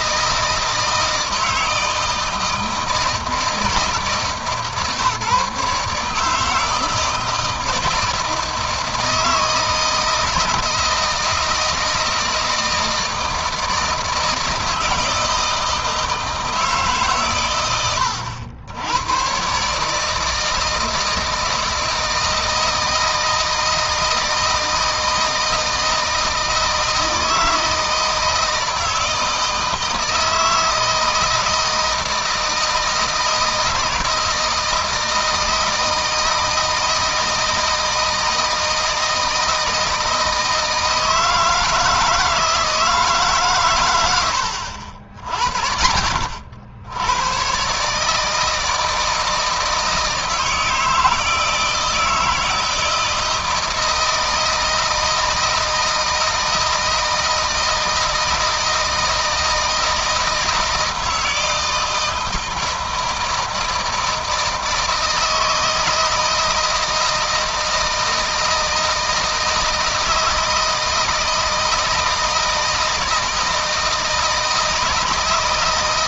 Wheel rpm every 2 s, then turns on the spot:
160, 160, 140, 160, 160, 160, 160, 160, 150, 100, 160, 160, 160, 160, 160, 160, 160, 160, 160, 160, 160, 160, 70, 90, 160, 160, 160, 160, 160, 160, 160, 160, 160, 160, 160, 160, 160, 160.
none